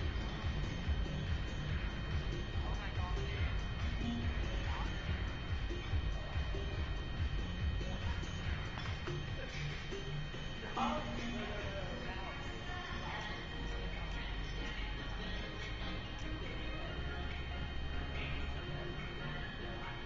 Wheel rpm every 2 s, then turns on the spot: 0, 0, 0, 0, 0, 0, 0, 0, 0, 0.
none